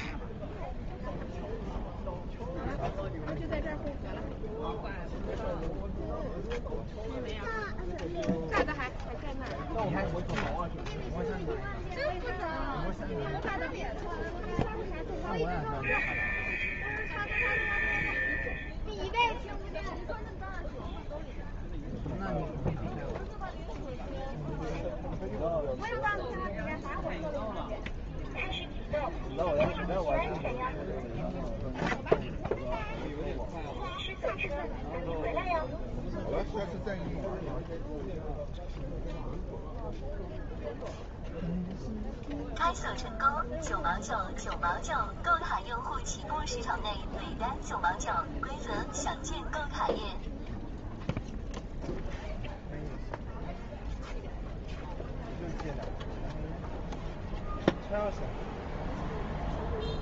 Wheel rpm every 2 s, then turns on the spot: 10, 0, 0, 0, 0, 0, 0, 0, 0, 0, 0, 0, 0, 0, 0, 0, 0, 0, 0, 0, 0, 0, 0, 0, 0, 0, 0, 0, 0, 0.
none